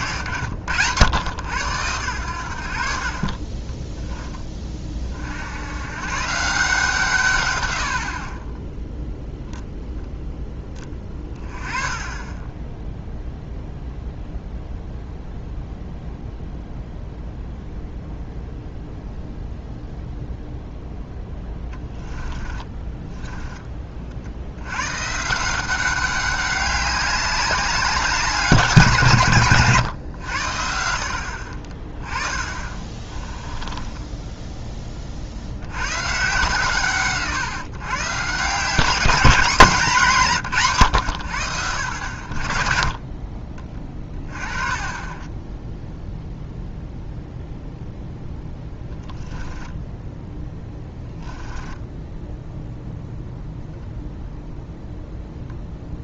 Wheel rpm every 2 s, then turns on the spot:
90, 80, 30, 160, 10, 10, 10, 0, 0, 0, 0, 10, 110, 200, 180, 70, 30, 20, 150, 190, 130, 50, 20, 0, 10, 10, 0, 0.
22-24 32-34 48-52